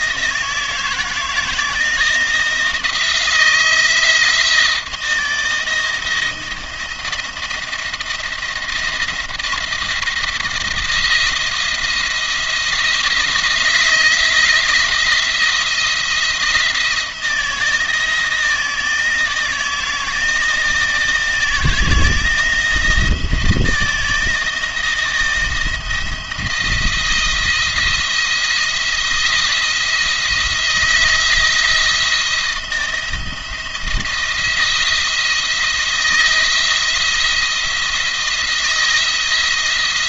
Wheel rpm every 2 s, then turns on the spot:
160, 160, 160, 170, 170, 170, 170, 170, 160, 160, 160, 160, 160, 170, 170, 160, 170, 170, 170, 170.
none